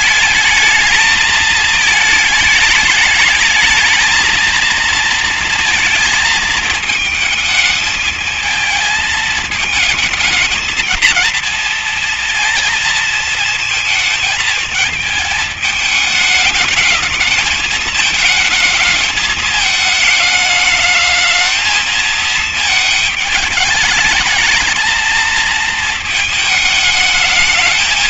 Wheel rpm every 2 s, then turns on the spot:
220, 220, 220, 220, 220, 220, 230, 220, 220, 220, 210, 220, 220, 220.
none